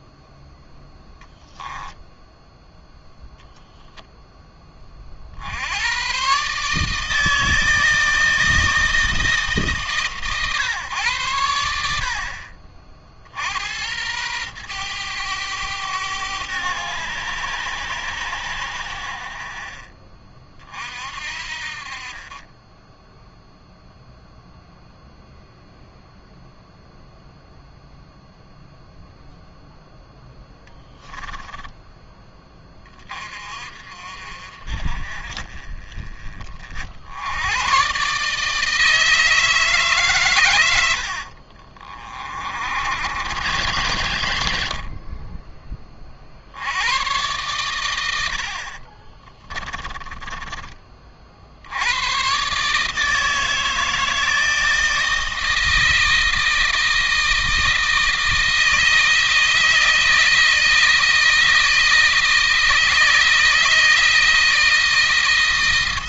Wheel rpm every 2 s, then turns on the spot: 0, 0, 30, 150, 160, 140, 50, 110, 100, 80, 40, 10, 0, 0, 0, 10, 40, 40, 60, 160, 90, 70, 60, 90, 50, 40, 150, 160, 160, 160, 160, 160, 160.
30-32 48-50